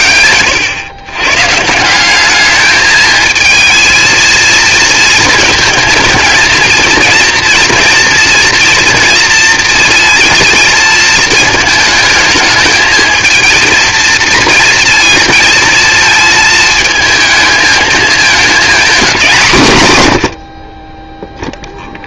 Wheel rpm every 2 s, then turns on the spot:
100, 210, 220, 220, 230, 230, 220, 230, 220, 220, 70.
none